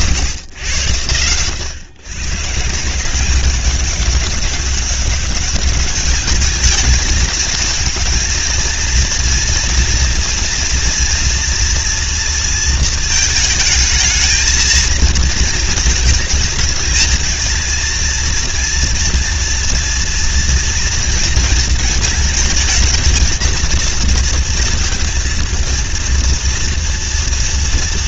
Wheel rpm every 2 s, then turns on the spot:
120, 160, 200, 220, 230, 240, 230, 220, 220, 230, 230, 230, 230, 230.
none